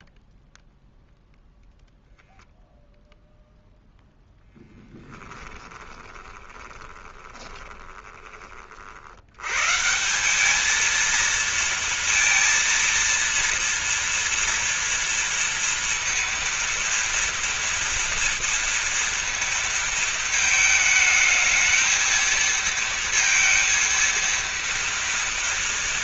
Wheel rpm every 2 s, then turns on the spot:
0, 0, 10, 20, 50, 220, 230, 230, 230, 230, 220, 230, 230.
4-8